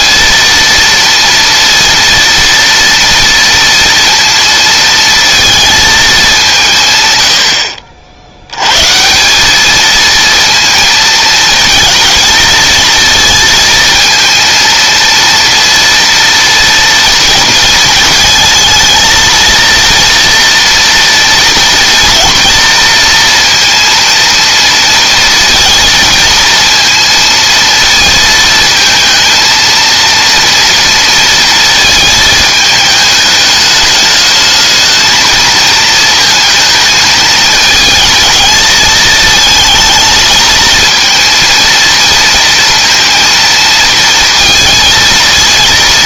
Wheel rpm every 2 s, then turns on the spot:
230, 230, 230, 120, 160, 220, 230, 230, 230, 230, 230, 230, 230, 230, 220, 230, 210, 220, 220, 220, 230, 230, 230.
none